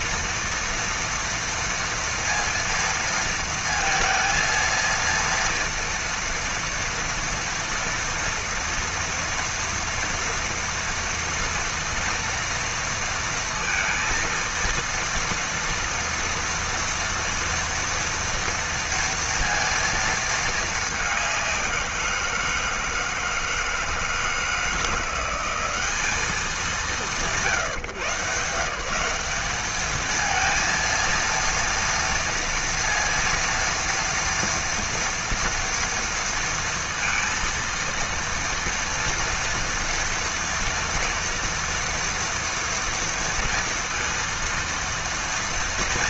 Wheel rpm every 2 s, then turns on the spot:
230, 230, 230, 230, 230, 230, 230, 230, 230, 230, 230, 170, 160, 200, 150, 220, 230, 230, 230, 230, 230, 230, 230.
none